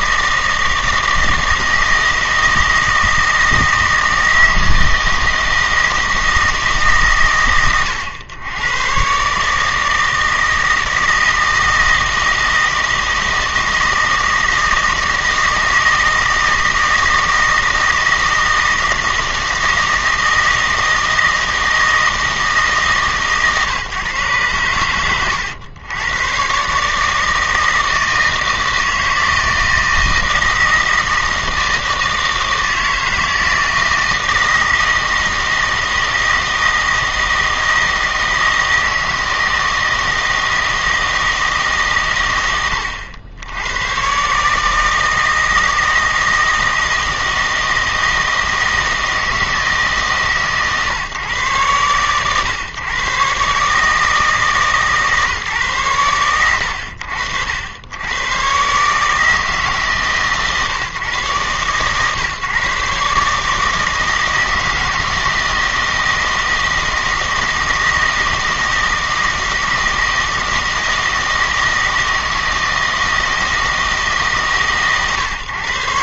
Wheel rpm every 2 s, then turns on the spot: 160, 160, 160, 150, 110, 160, 160, 160, 160, 160, 160, 160, 100, 140, 160, 160, 160, 160, 160, 160, 160, 110, 150, 160, 160, 140, 130, 150, 90, 130, 140, 140, 160, 160, 160, 160, 160, 140.
none